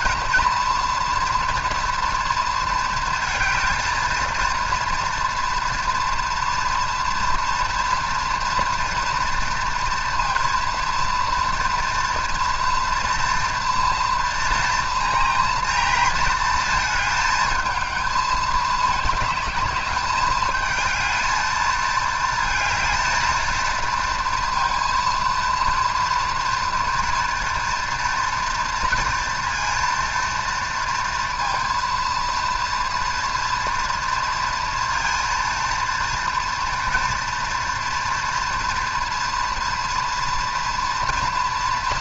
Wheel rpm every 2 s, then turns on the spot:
240, 230, 230, 230, 230, 230, 230, 230, 220, 210, 220, 230, 230, 230, 230, 230, 230, 230, 240, 230, 230.
none